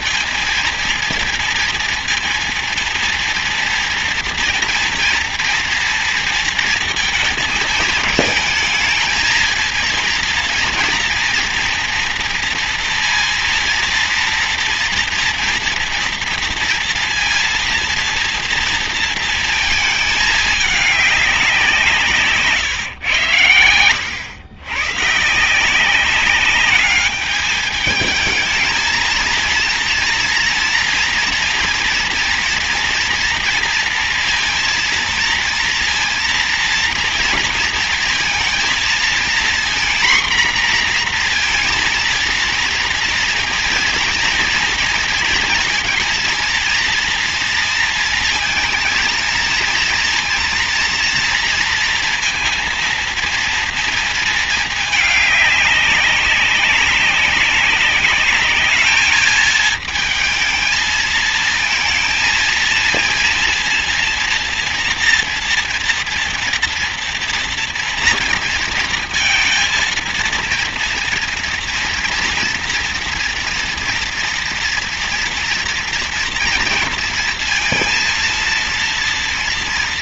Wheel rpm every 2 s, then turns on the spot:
230, 230, 230, 230, 220, 230, 230, 230, 230, 230, 200, 110, 130, 200, 230, 230, 230, 230, 230, 230, 240, 230, 230, 230, 230, 230, 230, 210, 190, 220, 220, 230, 240, 230, 230, 230, 230, 240, 240, 230.
none